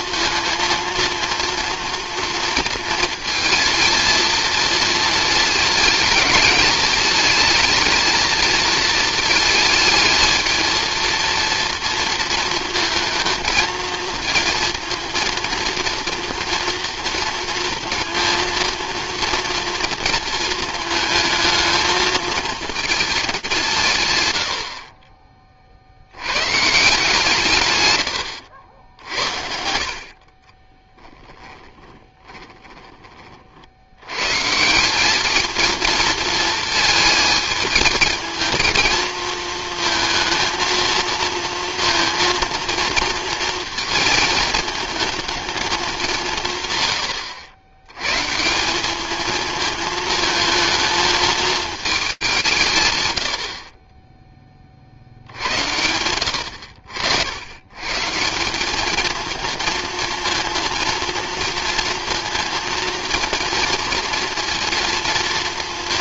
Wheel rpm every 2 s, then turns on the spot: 230, 230, 230, 210, 220, 220, 220, 230, 230, 230, 230, 220, 50, 150, 80, 20, 20, 160, 220, 220, 230, 230, 220, 120, 180, 220, 150, 40, 80, 190, 230, 230, 230.
30-34